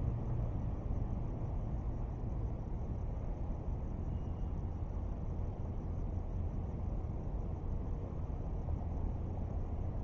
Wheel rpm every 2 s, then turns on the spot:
0, 0, 0, 0, 0.
none